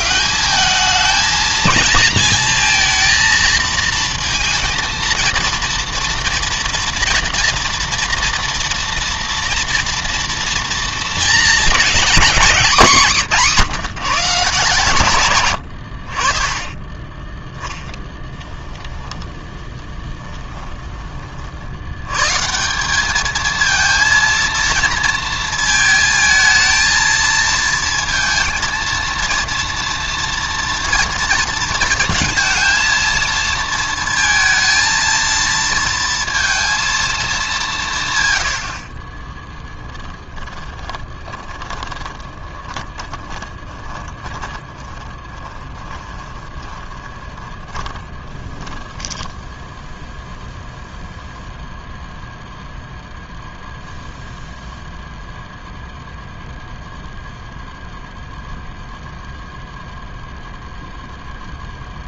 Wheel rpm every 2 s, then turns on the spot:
210, 220, 220, 230, 230, 230, 200, 140, 30, 10, 20, 180, 230, 220, 230, 230, 230, 230, 230, 70, 30, 30, 10, 20, 10, 0, 0, 0, 0, 0, 0.
16-22 40-50